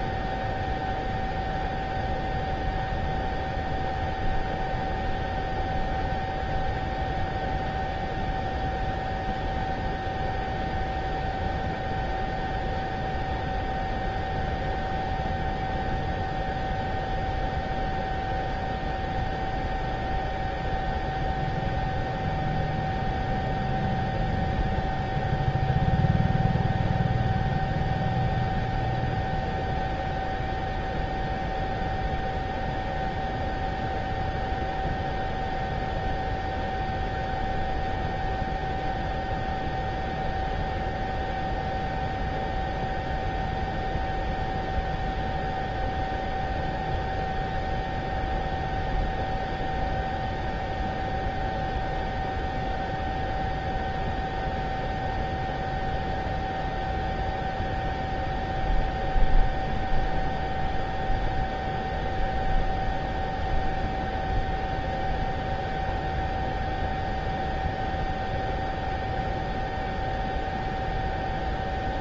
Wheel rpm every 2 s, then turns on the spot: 0, 0, 0, 0, 0, 0, 0, 0, 0, 0, 0, 0, 0, 0, 0, 0, 0, 0, 0, 0, 0, 0, 0, 0, 0, 0, 0, 0, 0, 0, 0, 0, 0, 0, 0, 0.
none